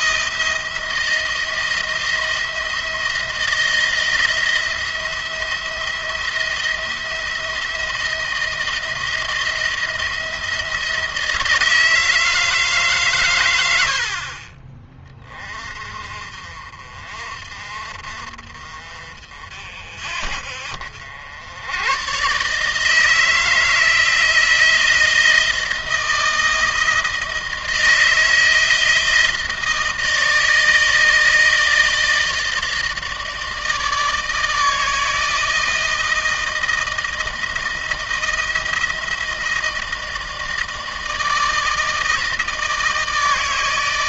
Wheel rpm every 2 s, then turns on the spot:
170, 170, 170, 170, 170, 170, 150, 40, 50, 50, 60, 150, 160, 170, 160, 160, 160, 160, 170, 160, 160, 160.
none